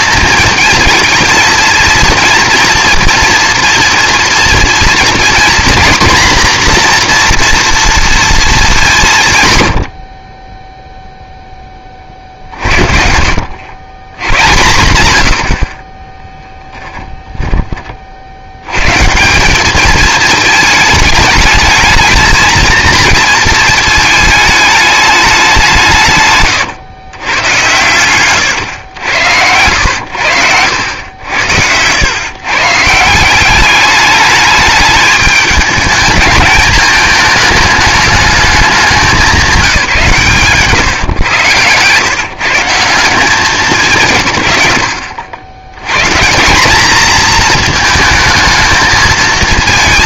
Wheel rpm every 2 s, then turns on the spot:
230, 230, 230, 240, 200, 0, 50, 100, 10, 100, 220, 230, 210, 120, 110, 90, 140, 210, 220, 200, 150, 170, 100, 210, 220.
16-18 40-42